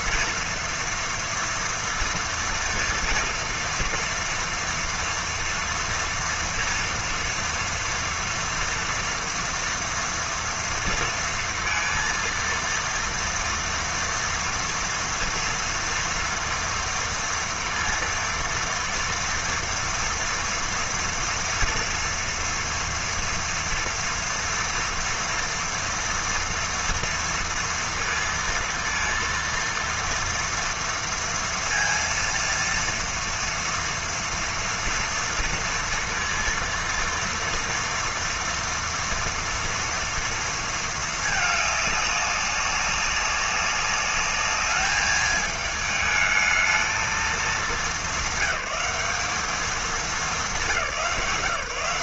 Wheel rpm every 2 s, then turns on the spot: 230, 230, 230, 230, 230, 230, 230, 230, 230, 230, 230, 230, 240, 240, 230, 230, 230, 230, 230, 230, 220, 200, 210, 220, 200, 170.
none